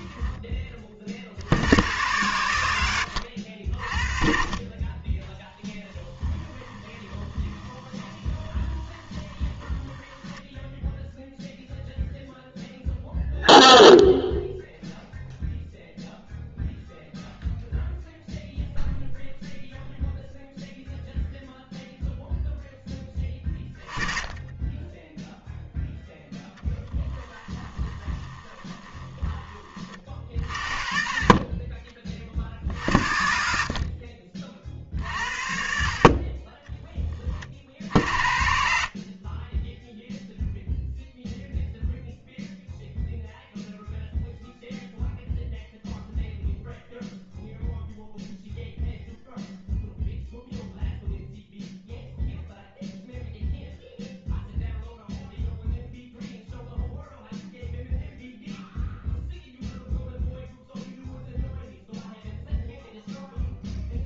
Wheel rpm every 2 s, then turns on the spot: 20, 80, 20, 20, 20, 0, 0, 0, 0, 0, 0, 0, 10, 10, 20, 30, 50, 40, 30, 70, 0, 0, 0, 0, 0, 0, 0, 0, 0, 0, 0, 0.
6-10 24-30